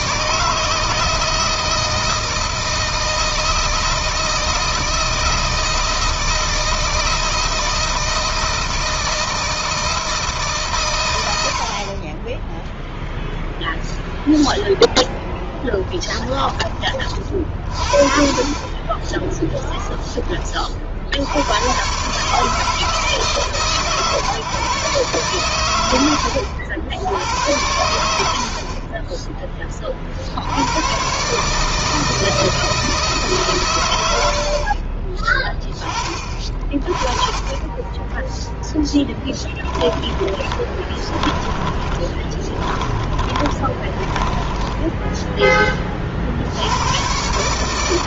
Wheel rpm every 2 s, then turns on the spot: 160, 160, 160, 160, 160, 130, 0, 0, 40, 30, 40, 160, 130, 80, 30, 100, 160, 40, 30, 10, 30, 20, 10, 90.
18-20 34-36 38-46